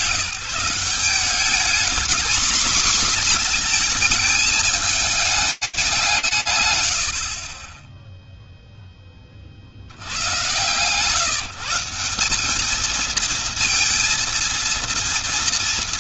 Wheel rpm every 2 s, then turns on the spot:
160, 230, 220, 130, 0, 120, 210, 230.
none